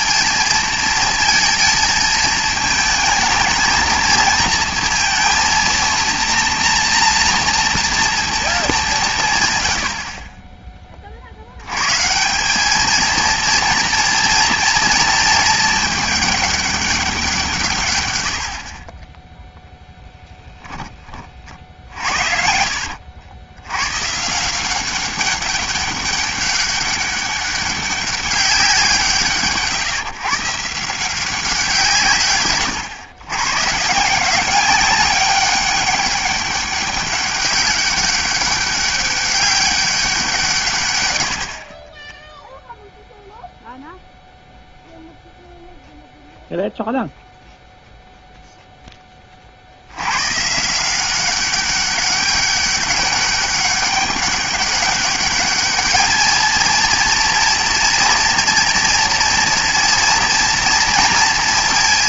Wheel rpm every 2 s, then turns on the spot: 230, 220, 230, 230, 210, 20, 210, 230, 210, 50, 30, 70, 180, 200, 190, 150, 120, 190, 200, 200, 130, 0, 0, 0, 0, 160, 200, 200, 230, 230, 230.
20-24